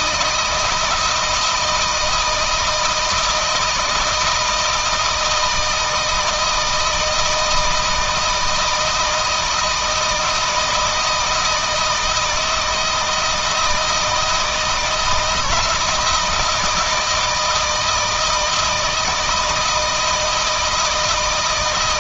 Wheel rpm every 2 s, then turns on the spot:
160, 160, 160, 160, 160, 160, 160, 160, 160, 160, 160.
none